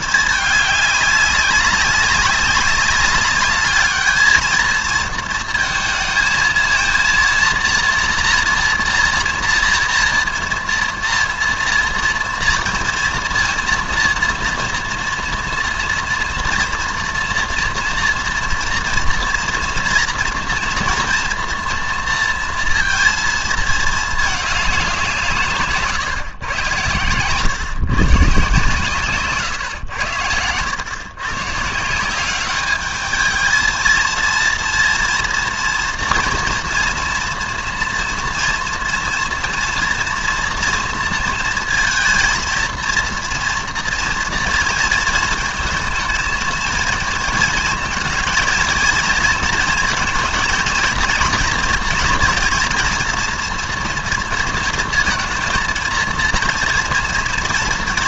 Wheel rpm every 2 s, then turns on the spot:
210, 200, 220, 220, 230, 230, 230, 230, 230, 230, 230, 230, 200, 120, 150, 100, 210, 230, 230, 230, 230, 230, 230, 230, 230, 230, 230, 230, 230.
none